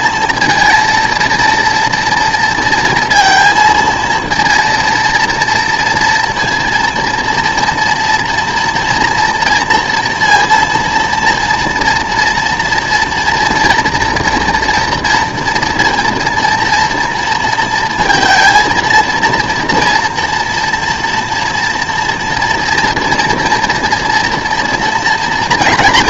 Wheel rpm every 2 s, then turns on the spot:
230, 230, 230, 230, 230, 230, 230, 230, 240, 230, 230, 230, 230.
none